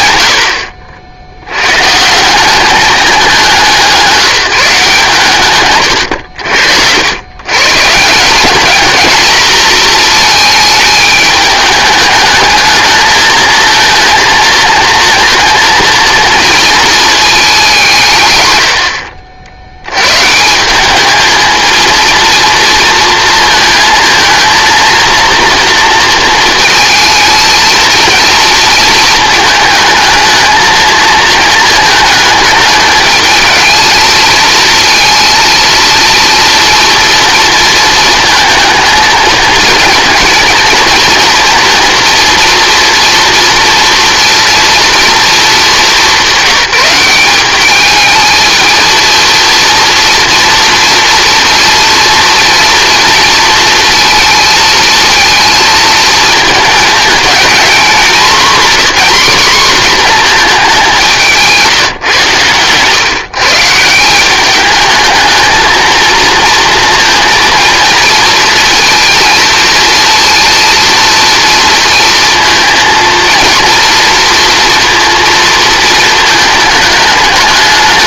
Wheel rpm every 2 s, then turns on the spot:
60, 200, 150, 90, 220, 220, 220, 230, 230, 90, 190, 230, 230, 220, 230, 220, 210, 230, 230, 230, 240, 240, 240, 190, 220, 230, 230, 220, 220, 230, 200, 120, 210, 230, 230, 230, 230, 230, 210.
18-20